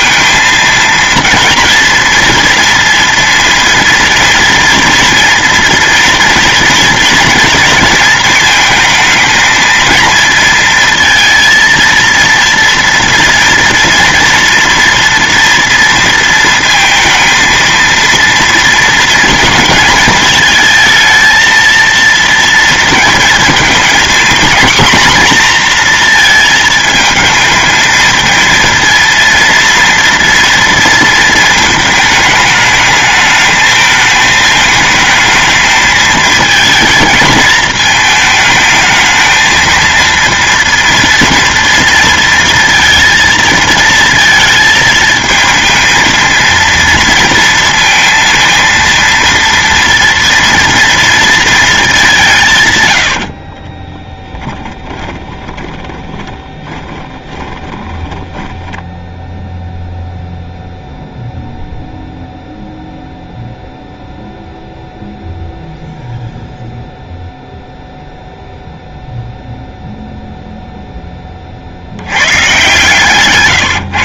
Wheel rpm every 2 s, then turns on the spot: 230, 230, 230, 230, 230, 230, 230, 240, 230, 230, 220, 230, 240, 220, 230, 230, 220, 220, 220, 220, 230, 230, 220, 230, 230, 230, 130, 20, 20, 10, 0, 0, 0, 0, 0, 0, 130.
54-60